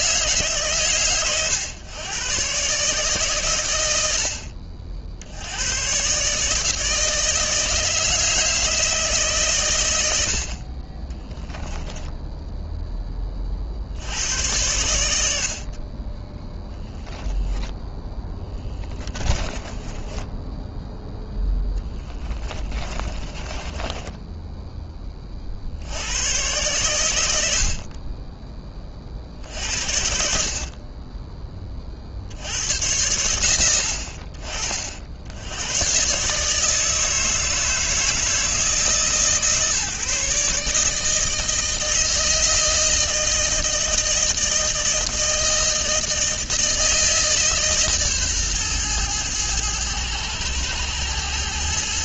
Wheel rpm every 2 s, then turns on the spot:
120, 140, 60, 160, 160, 20, 10, 90, 0, 20, 0, 20, 20, 100, 50, 30, 100, 70, 160, 150, 160, 160, 160, 160, 110, 110.
10-12 18-20 22-24